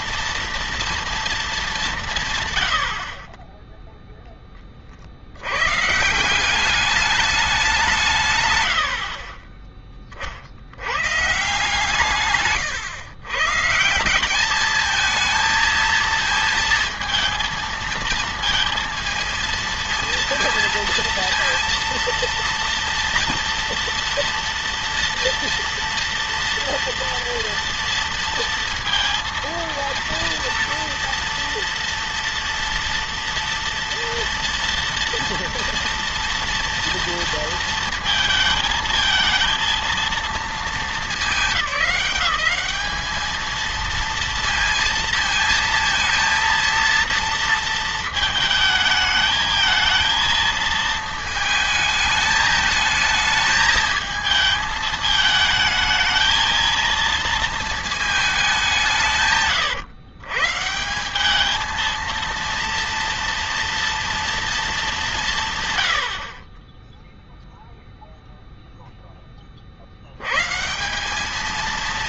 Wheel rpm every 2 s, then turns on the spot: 230, 70, 60, 200, 70, 110, 120, 220, 230, 230, 230, 230, 230, 230, 230, 230, 230, 230, 230, 220, 220, 190, 220, 230, 220, 220, 220, 220, 230, 190, 150, 230, 210, 10, 0, 150.
none